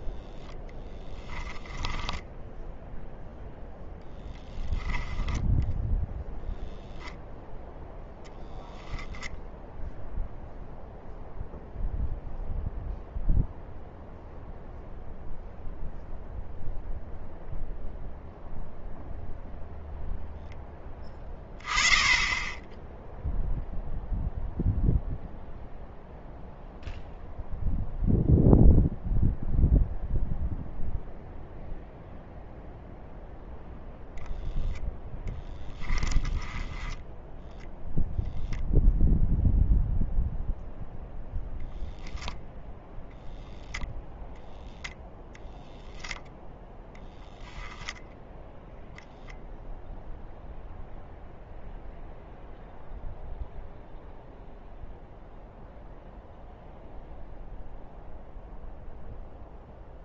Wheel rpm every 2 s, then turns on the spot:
0, 0, 10, 0, 0, 0, 0, 0, 0, 0, 10, 10, 0, 0, 0, 0, 0, 0, 10, 0, 0, 0, 0, 0, 0, 0, 0, 0, 0, 0.
4-6 36-38